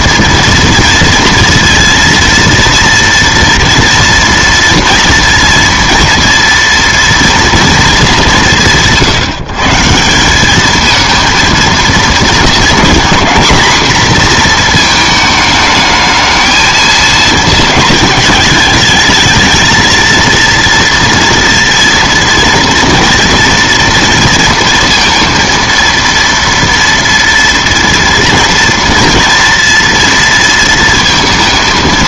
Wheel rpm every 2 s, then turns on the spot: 230, 230, 230, 230, 160, 220, 230, 230, 220, 220, 230, 230, 230, 230, 230, 230.
none